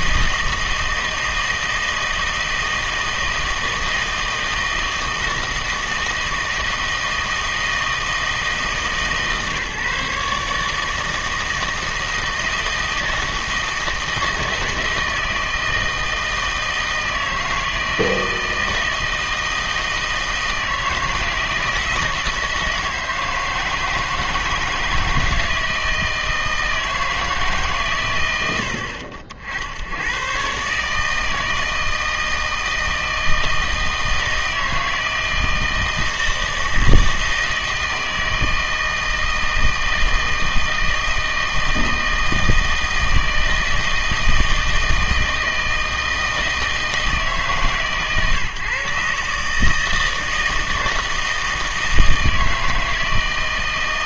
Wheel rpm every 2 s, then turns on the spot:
160, 160, 160, 160, 150, 150, 160, 160, 160, 160, 160, 160, 160, 160, 80, 130, 160, 160, 160, 160, 160, 160, 160, 160, 140, 160, 160.
none